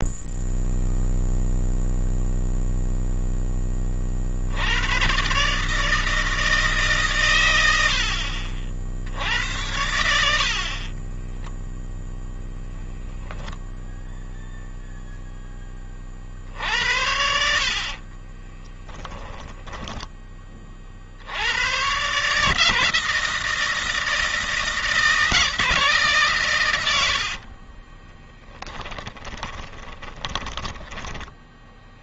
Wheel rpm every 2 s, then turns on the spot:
0, 0, 110, 140, 70, 30, 0, 0, 60, 20, 50, 160, 160, 100, 10, 10.
10-12 16-20 26-30